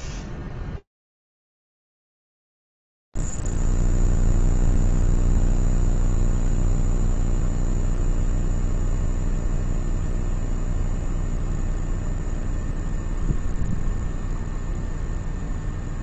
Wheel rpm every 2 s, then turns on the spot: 0, 0, 0, 0, 0, 0, 0, 0.
none